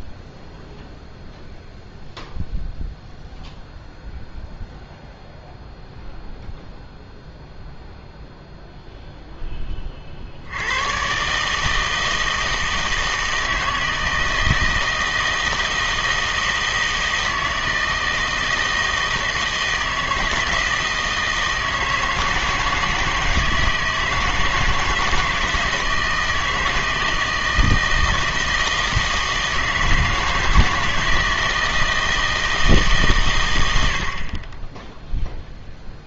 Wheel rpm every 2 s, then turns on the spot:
0, 0, 0, 0, 0, 100, 160, 160, 160, 160, 160, 160, 160, 160, 160, 160, 150, 10.
none